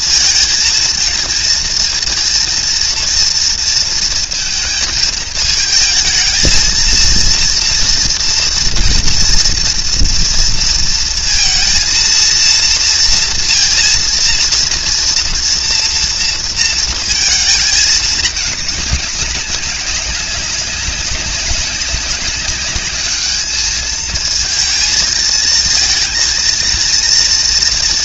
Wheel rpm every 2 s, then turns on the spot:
230, 230, 220, 220, 230, 230, 230, 230, 230, 210, 190, 200, 220, 230.
none